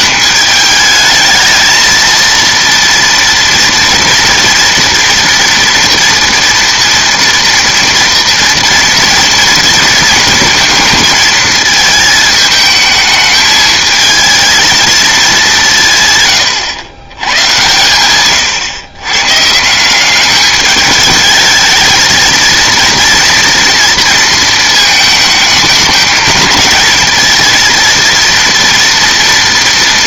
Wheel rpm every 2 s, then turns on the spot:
200, 230, 230, 230, 230, 230, 220, 220, 110, 120, 210, 230, 220, 220, 230.
none